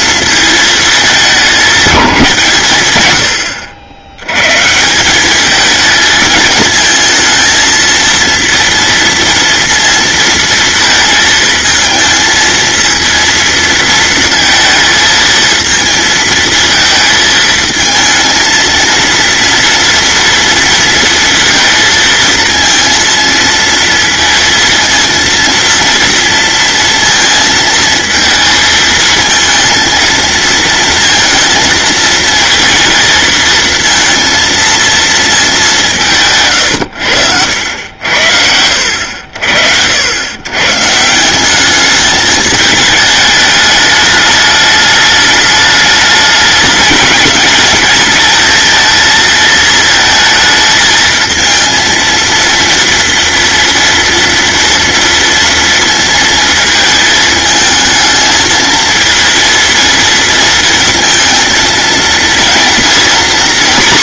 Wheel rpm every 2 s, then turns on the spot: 220, 140, 130, 220, 230, 230, 220, 220, 220, 220, 230, 230, 230, 230, 220, 230, 230, 230, 120, 80, 130, 210, 210, 220, 220, 220, 230, 230, 220, 220, 230, 230.
none